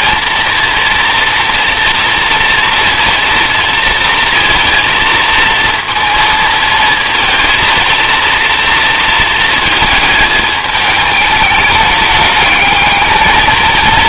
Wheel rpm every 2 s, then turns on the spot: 230, 230, 230, 230, 230, 220, 210.
none